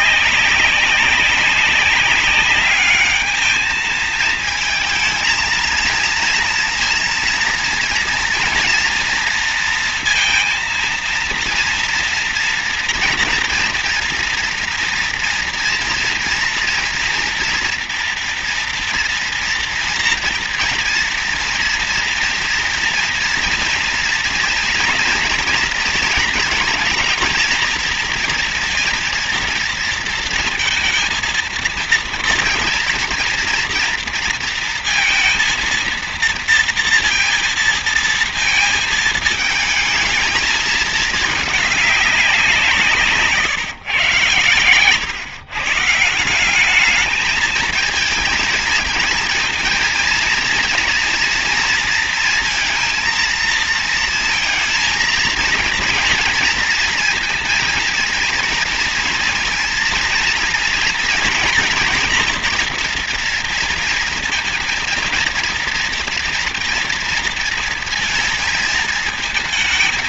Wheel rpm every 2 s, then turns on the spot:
190, 200, 220, 230, 230, 230, 230, 230, 230, 230, 230, 230, 230, 220, 230, 230, 230, 230, 230, 220, 220, 180, 110, 180, 220, 230, 230, 230, 230, 230, 230, 240, 230, 230, 230.
none